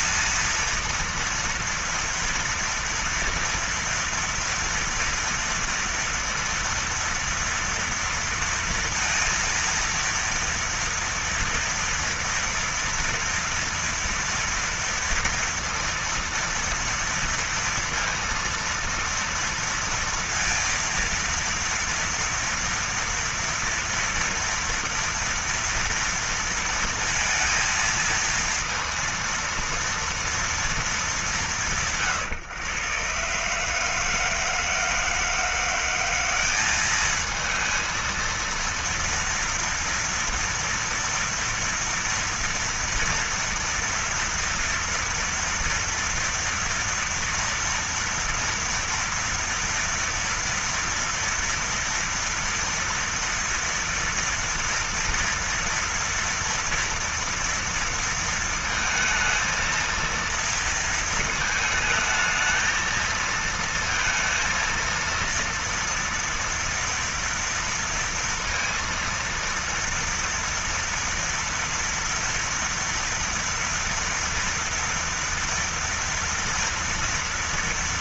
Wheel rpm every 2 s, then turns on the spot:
230, 230, 230, 230, 230, 230, 230, 230, 230, 230, 230, 230, 230, 230, 230, 230, 140, 160, 200, 230, 230, 230, 240, 230, 230, 230, 230, 230, 230, 230, 230, 220, 230, 230, 230, 230, 230, 230, 230.
none